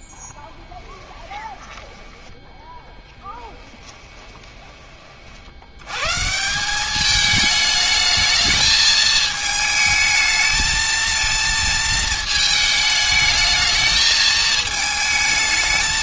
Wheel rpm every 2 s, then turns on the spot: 10, 10, 20, 180, 220, 220, 220, 220.
0-2 4-6